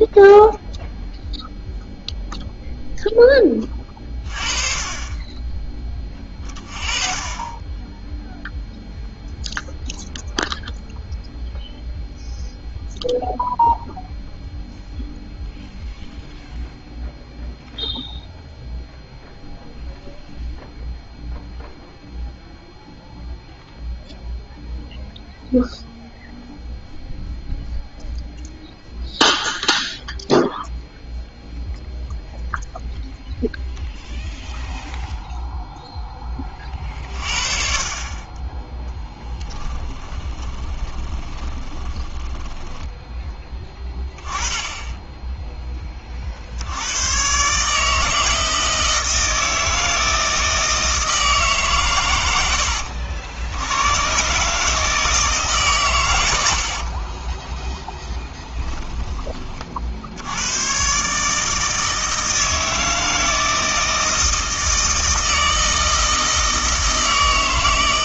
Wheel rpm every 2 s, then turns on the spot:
0, 0, 30, 20, 0, 0, 0, 0, 0, 0, 0, 0, 0, 0, 0, 0, 0, 0, 30, 10, 20, 10, 10, 80, 160, 160, 80, 150, 70, 10, 110, 160, 160, 160.
40-44 58-60